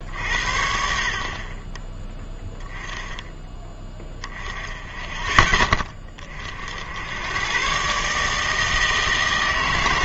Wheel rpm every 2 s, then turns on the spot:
60, 10, 10, 60, 160.
none